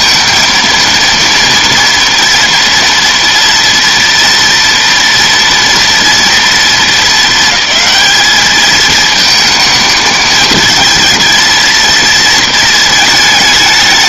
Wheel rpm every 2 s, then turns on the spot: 230, 230, 230, 220, 220, 220, 220.
none